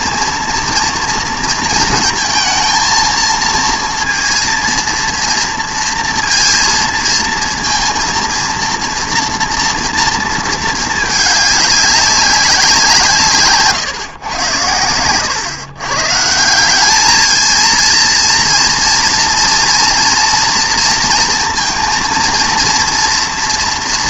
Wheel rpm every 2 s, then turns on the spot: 230, 230, 230, 230, 230, 220, 170, 110, 200, 230, 230, 230.
none